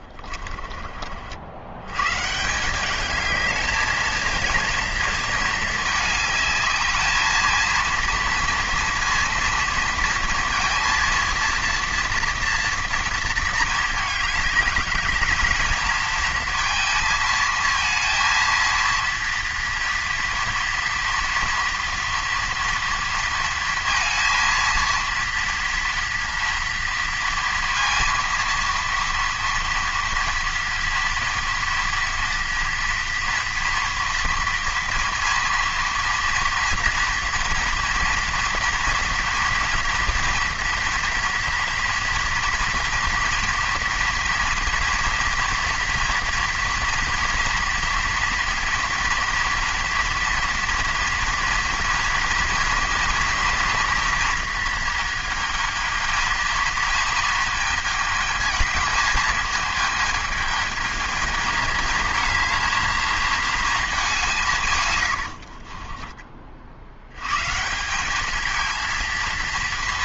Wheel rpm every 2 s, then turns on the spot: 30, 180, 230, 210, 230, 230, 230, 200, 230, 230, 230, 230, 230, 230, 230, 230, 230, 230, 230, 230, 230, 230, 230, 230, 230, 230, 230, 230, 220, 220, 220, 220, 160, 50, 220.
none